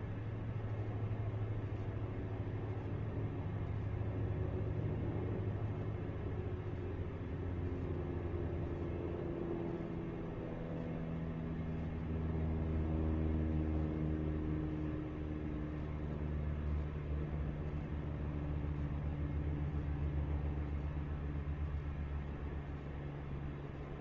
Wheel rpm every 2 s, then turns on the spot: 0, 0, 0, 0, 0, 0, 0, 0, 0, 0, 0, 0.
none